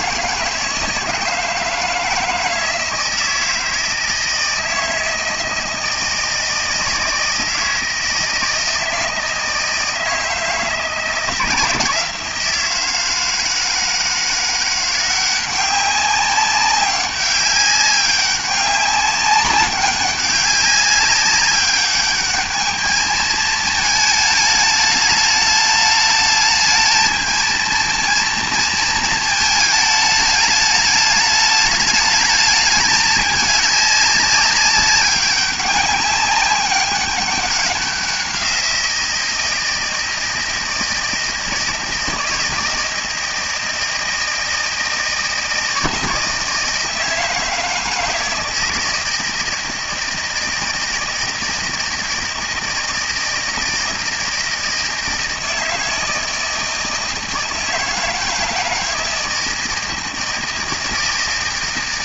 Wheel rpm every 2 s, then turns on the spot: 160, 160, 160, 160, 160, 160, 160, 180, 200, 200, 200, 210, 210, 220, 230, 210, 210, 200, 200, 180, 160, 160, 160, 160, 160, 160, 160, 160, 160, 160, 160.
none